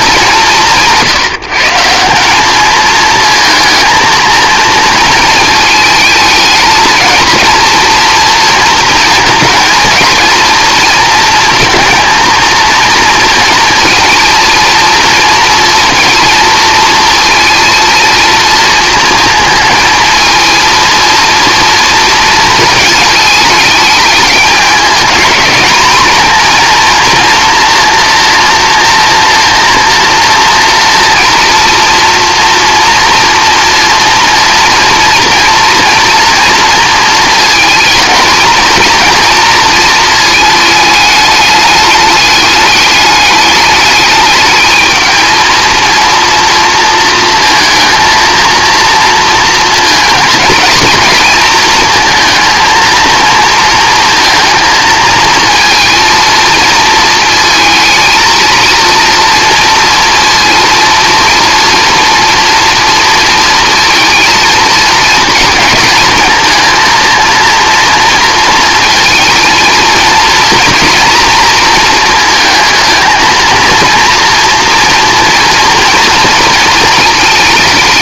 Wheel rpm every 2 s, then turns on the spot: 160, 210, 230, 220, 230, 230, 230, 230, 230, 230, 230, 230, 220, 230, 240, 230, 230, 230, 230, 230, 220, 210, 220, 230, 230, 220, 230, 230, 220, 230, 230, 230, 220, 230, 230, 240, 220, 230, 230.
none